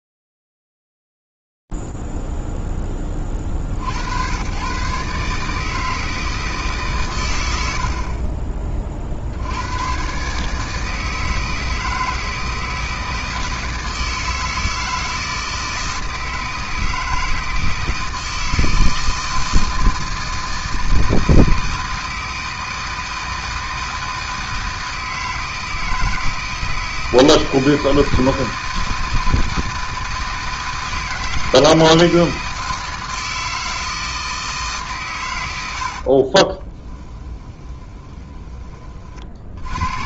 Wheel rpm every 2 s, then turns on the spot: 0, 0, 70, 160, 60, 110, 160, 160, 160, 160, 160, 160, 160, 160, 160, 160, 160, 160, 60, 20.
8-10 36-40